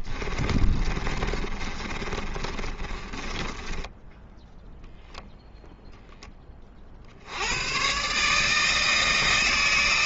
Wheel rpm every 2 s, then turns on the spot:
40, 30, 0, 40, 160.
0-4